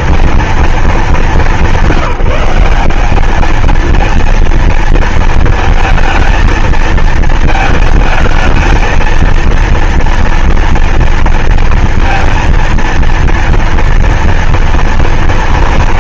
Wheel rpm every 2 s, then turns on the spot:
230, 190, 230, 220, 220, 230, 230, 230.
none